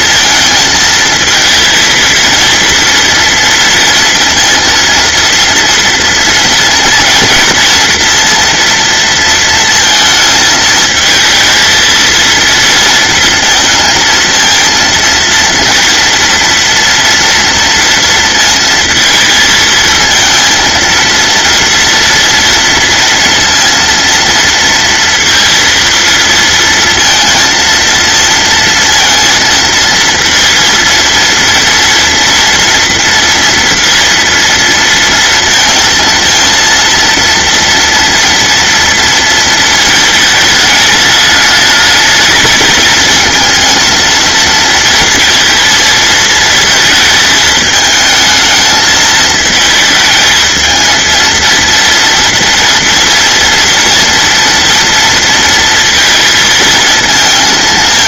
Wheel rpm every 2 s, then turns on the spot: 230, 230, 230, 230, 230, 230, 220, 230, 230, 230, 220, 230, 230, 230, 230, 230, 230, 230, 230, 230, 230, 210, 230, 230, 220, 220, 230, 230, 230.
none